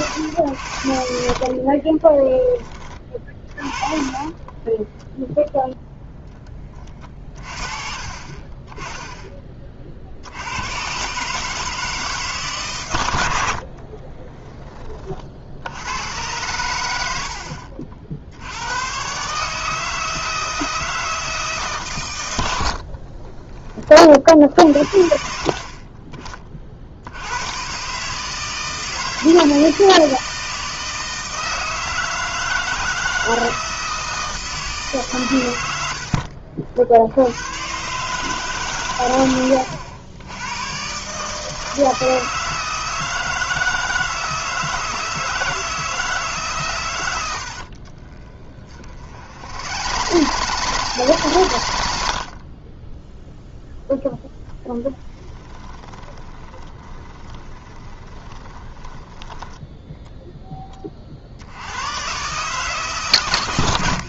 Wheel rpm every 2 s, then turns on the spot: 80, 20, 20, 20, 20, 90, 140, 20, 110, 90, 160, 80, 60, 40, 160, 160, 160, 160, 50, 140, 110, 160, 160, 140, 30, 110, 20, 10, 20, 20, 20, 140.
4-6 48-52 56-60